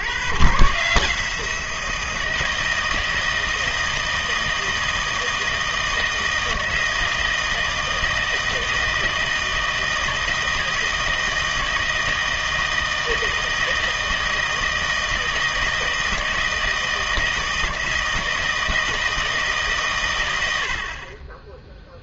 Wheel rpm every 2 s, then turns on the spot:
130, 160, 160, 160, 160, 160, 160, 160, 160, 160, 80.
none